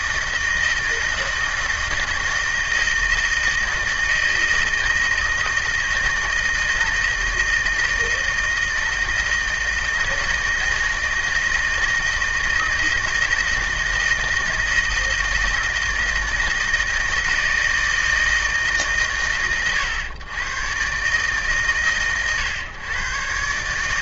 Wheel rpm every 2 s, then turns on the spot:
160, 160, 160, 160, 160, 160, 160, 160, 160, 130, 120, 120.
none